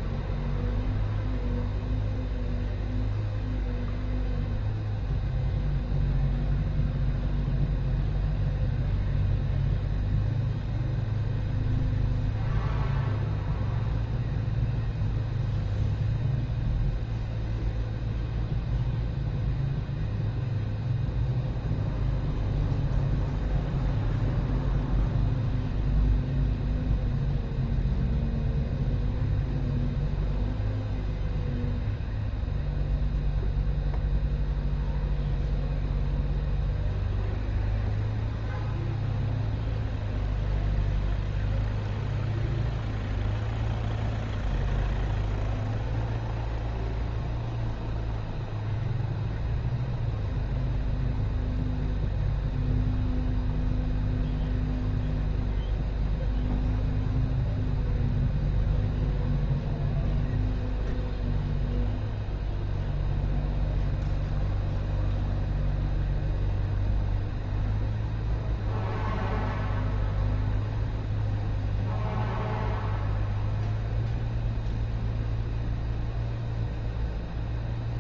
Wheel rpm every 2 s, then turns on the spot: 0, 0, 0, 0, 0, 0, 0, 0, 0, 0, 0, 0, 0, 0, 0, 0, 0, 0, 0, 0, 0, 0, 0, 0, 0, 0, 0, 0, 0, 0, 0, 0, 0, 0, 0, 0, 0, 0, 0.
none